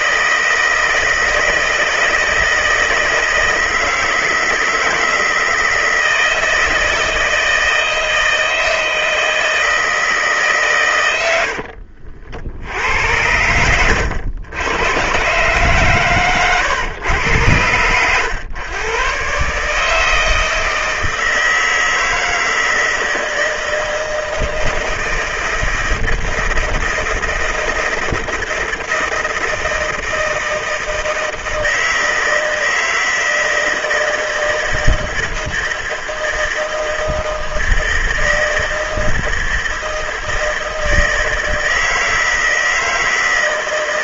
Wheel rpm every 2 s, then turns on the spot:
160, 160, 160, 160, 160, 140, 70, 100, 120, 110, 160, 160, 160, 160, 160, 160, 160, 160, 160, 160, 160, 160.
none